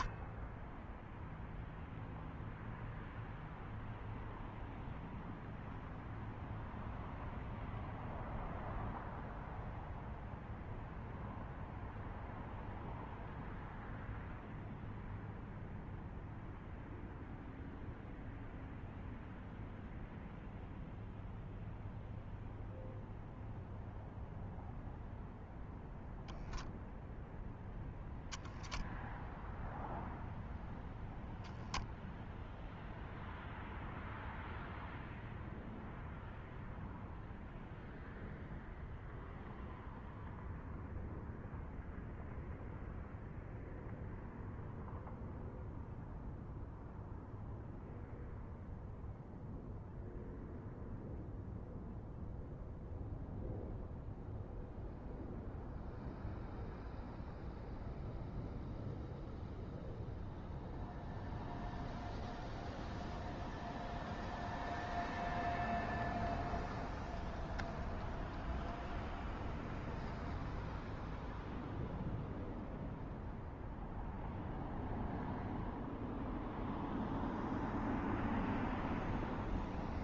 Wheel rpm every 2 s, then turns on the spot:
0, 0, 0, 0, 0, 0, 0, 0, 0, 0, 0, 0, 0, 0, 0, 0, 0, 0, 0, 0, 0, 0, 0, 0, 0, 0, 0, 0, 0, 0, 0, 0, 0, 0, 0, 0, 0, 0, 0, 0.
none